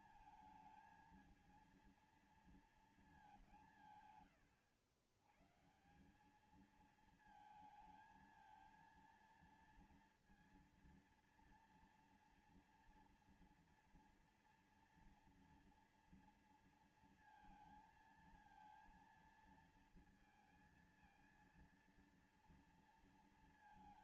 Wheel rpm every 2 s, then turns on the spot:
220, 230, 110, 210, 220, 230, 230, 230, 230, 220, 230, 230.
none